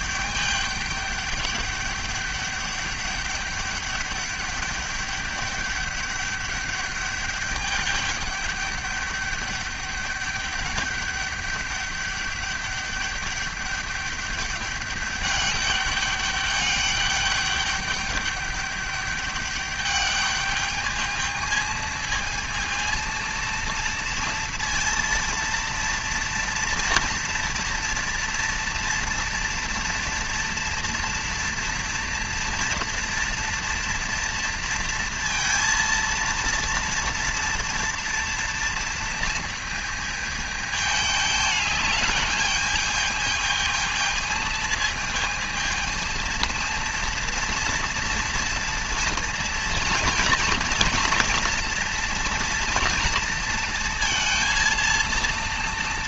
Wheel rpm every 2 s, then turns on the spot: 200, 200, 200, 200, 200, 200, 200, 200, 200, 200, 210, 230, 230, 230, 230, 230, 230, 230, 230, 230, 220, 210, 220, 230, 230, 230, 230, 230.
none